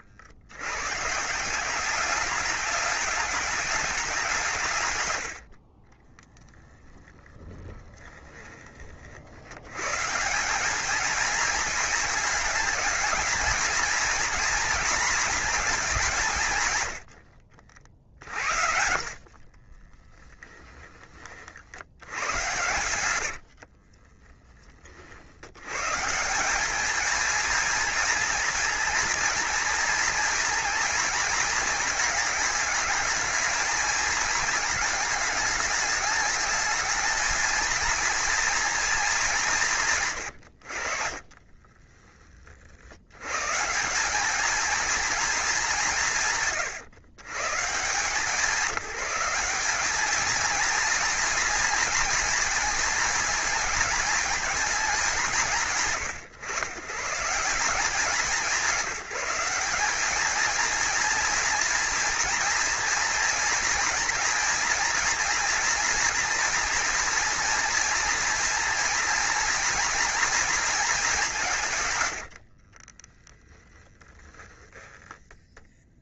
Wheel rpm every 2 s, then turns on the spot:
120, 200, 130, 10, 40, 210, 220, 230, 90, 50, 20, 100, 40, 220, 240, 230, 220, 210, 220, 220, 60, 80, 230, 120, 180, 230, 230, 190, 130, 190, 220, 230, 230, 230, 230, 210, 30, 0.
22-24 40-42 72-74